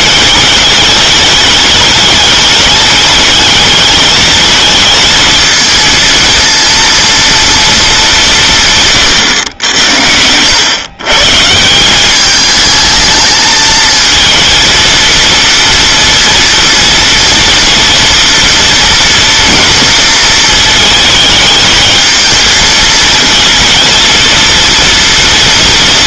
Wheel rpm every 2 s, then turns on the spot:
200, 210, 220, 230, 170, 110, 220, 230, 230, 230, 230, 220, 230.
none